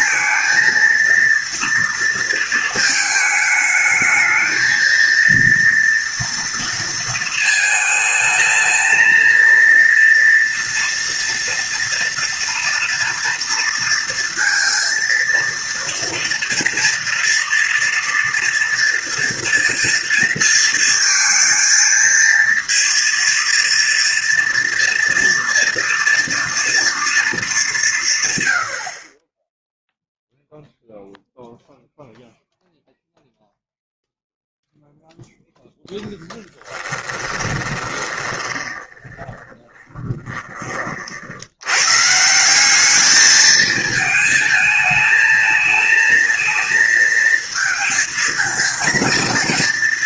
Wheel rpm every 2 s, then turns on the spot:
230, 220, 230, 230, 230, 230, 230, 230, 240, 230, 230, 230, 230, 230, 50, 0, 0, 0, 10, 20, 40, 200, 220, 230, 230.
36-40